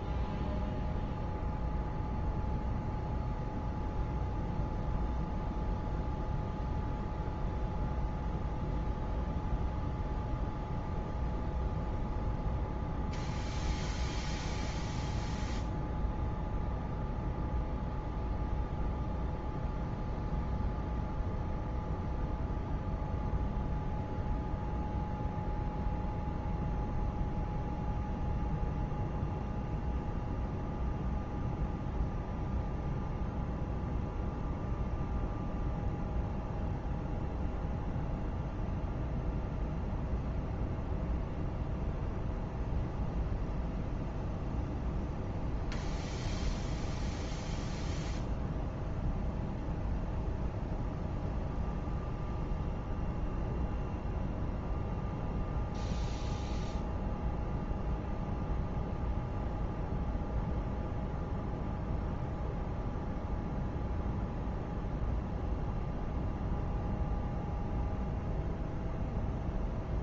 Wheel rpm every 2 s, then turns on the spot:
0, 0, 0, 0, 0, 0, 0, 0, 0, 0, 0, 0, 0, 0, 0, 0, 0, 0, 0, 0, 0, 0, 0, 0, 0, 0, 0, 0, 0, 0, 0, 0, 0, 0, 0.
none